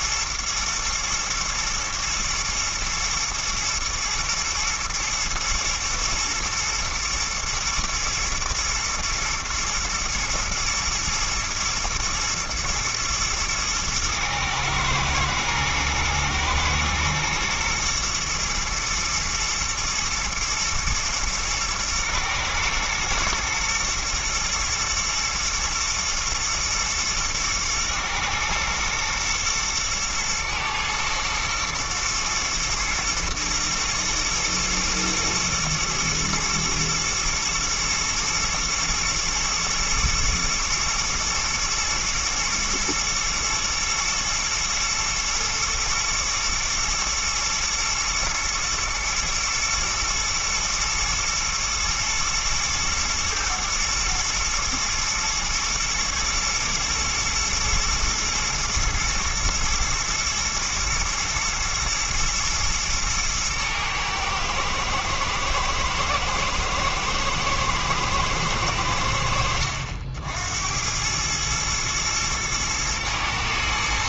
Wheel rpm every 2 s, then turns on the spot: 120, 120, 110, 120, 110, 110, 110, 110, 120, 120, 110, 110, 110, 120, 110, 110, 120, 110, 110, 110, 120, 110, 110, 110, 120, 110, 110, 120, 110, 120, 120, 110, 110, 120, 100, 80, 110.
none